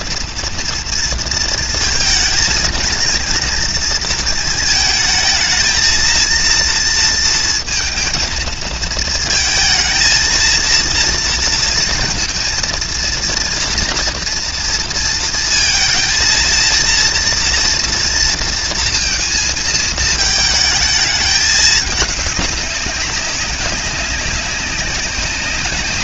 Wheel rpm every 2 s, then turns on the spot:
230, 230, 230, 230, 220, 230, 230, 230, 230, 230, 220, 200, 190.
none